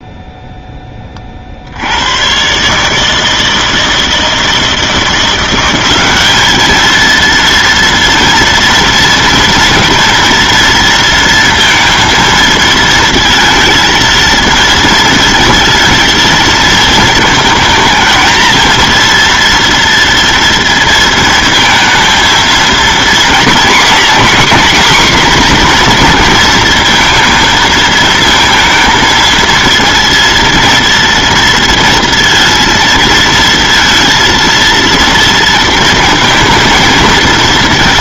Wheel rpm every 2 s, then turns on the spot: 0, 140, 160, 210, 230, 230, 220, 220, 230, 230, 230, 230, 250, 230, 230, 230, 230, 230, 220.
none